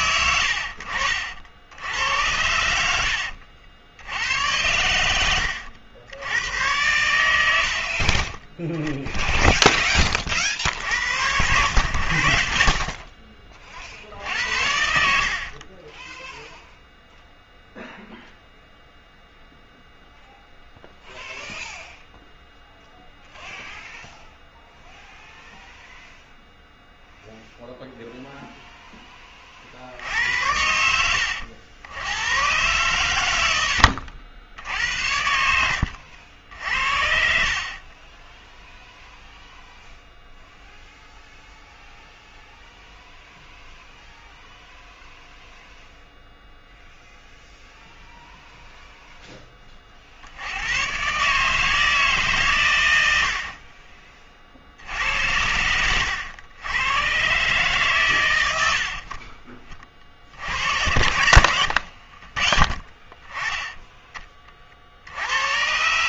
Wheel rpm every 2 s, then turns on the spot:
70, 80, 100, 90, 20, 70, 50, 70, 0, 0, 0, 0, 0, 0, 0, 70, 120, 90, 60, 0, 0, 0, 0, 0, 0, 110, 110, 60, 100, 70, 70, 40, 50.
2-4